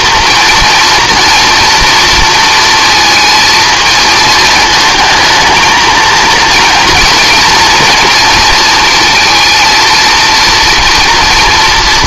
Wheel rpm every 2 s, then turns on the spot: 230, 230, 220, 230, 230, 230.
none